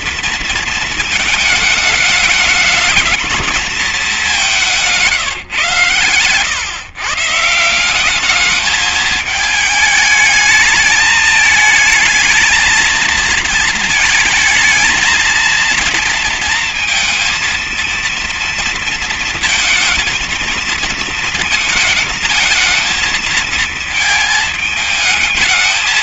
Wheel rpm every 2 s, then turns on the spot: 220, 220, 160, 150, 220, 220, 220, 230, 230, 230, 220, 220, 220.
none